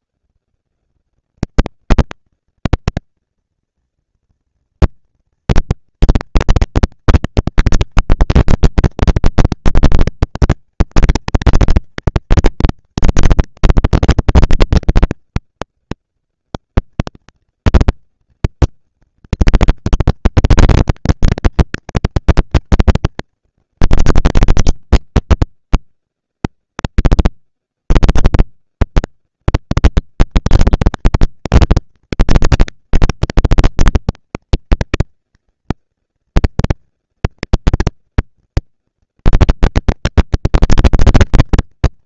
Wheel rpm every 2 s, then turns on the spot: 130, 220, 230, 230, 230, 230, 230, 230, 240, 230, 230, 220, 200, 190, 110, 200, 230, 220, 230, 230, 230.
none